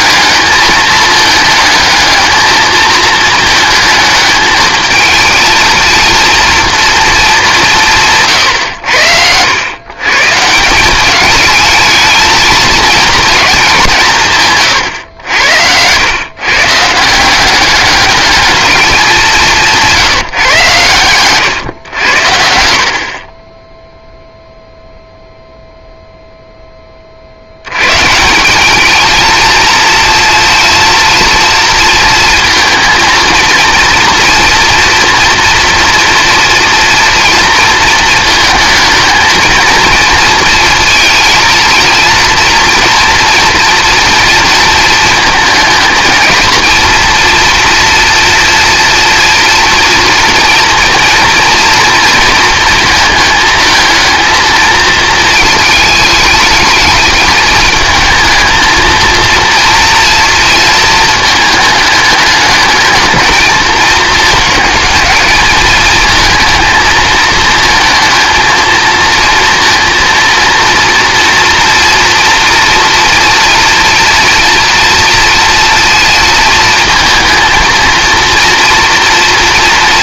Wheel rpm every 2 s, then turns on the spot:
220, 220, 220, 230, 90, 200, 230, 110, 160, 200, 120, 40, 0, 30, 220, 230, 230, 230, 230, 220, 230, 230, 220, 230, 240, 230, 220, 230, 220, 230, 220, 220, 210, 220, 230, 230, 240, 230, 220, 240.
none